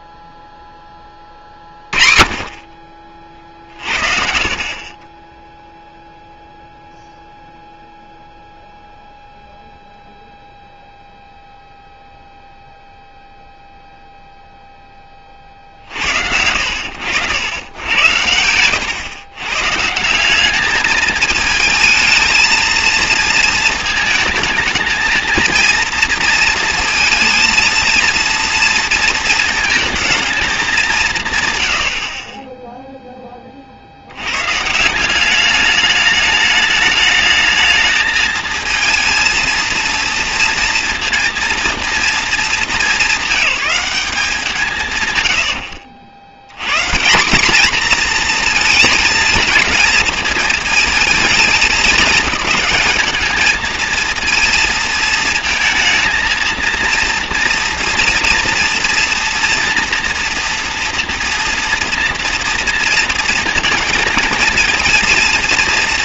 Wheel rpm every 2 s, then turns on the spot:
0, 30, 40, 0, 0, 0, 0, 0, 80, 110, 200, 220, 220, 230, 230, 210, 20, 140, 210, 230, 230, 210, 160, 120, 230, 230, 210, 230, 230, 230, 230, 230, 230.
4-6 18-20